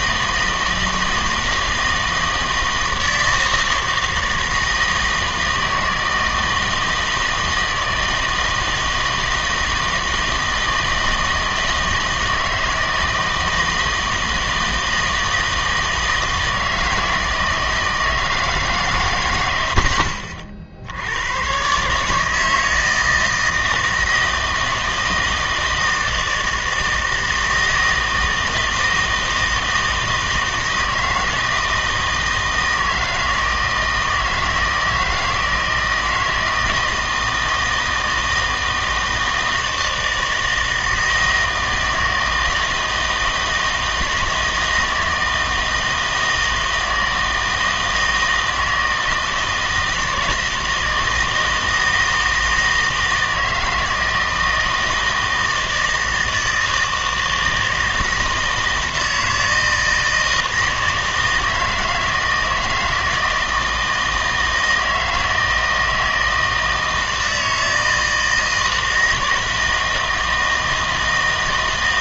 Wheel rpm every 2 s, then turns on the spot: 160, 160, 160, 160, 160, 160, 160, 160, 160, 150, 60, 160, 160, 160, 160, 160, 160, 160, 160, 160, 160, 160, 160, 160, 160, 160, 160, 160, 160, 160, 160, 160, 160, 160, 160, 160.
none